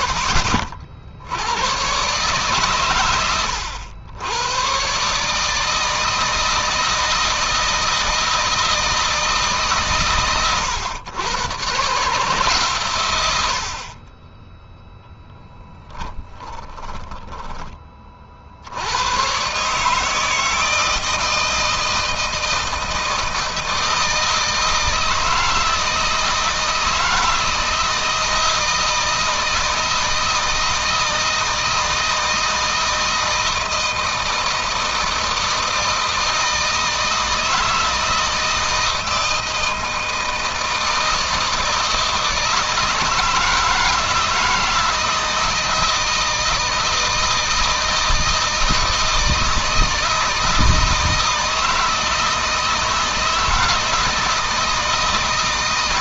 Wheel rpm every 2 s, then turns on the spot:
60, 130, 120, 160, 160, 110, 140, 10, 20, 70, 160, 160, 160, 160, 160, 160, 160, 160, 160, 160, 160, 160, 160, 160, 160, 160, 160, 160.
16-18